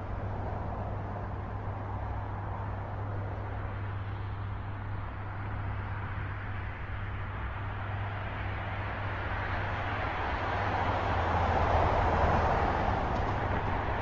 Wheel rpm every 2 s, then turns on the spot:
0, 0, 0, 0, 0, 0, 0.
none